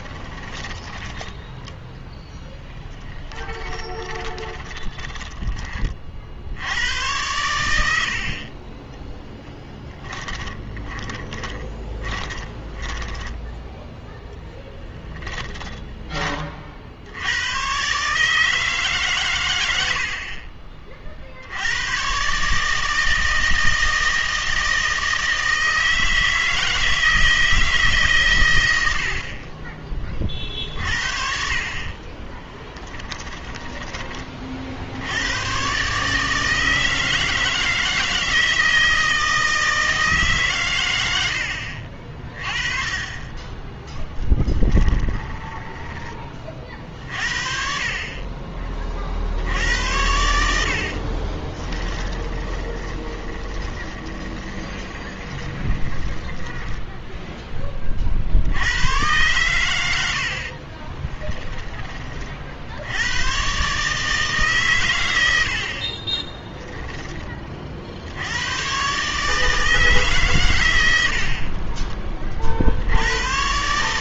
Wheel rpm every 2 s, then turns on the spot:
20, 10, 20, 90, 30, 20, 20, 10, 40, 150, 30, 150, 160, 160, 100, 50, 20, 50, 160, 160, 130, 30, 10, 40, 30, 70, 20, 20, 10, 90, 40, 70, 130, 10, 110, 100, 60.
0-6 10-16 32-34 44-46 52-58 60-62